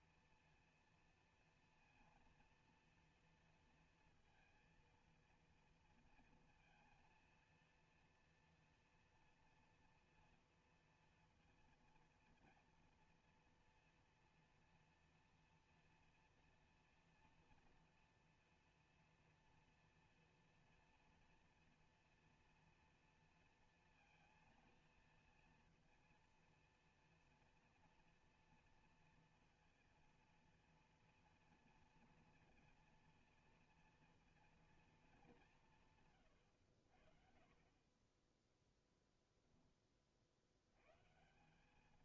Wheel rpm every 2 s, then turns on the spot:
230, 230, 230, 230, 240, 230, 240, 230, 240, 230, 230, 240, 230, 230, 230, 230, 230, 230, 110, 10, 80.
38-40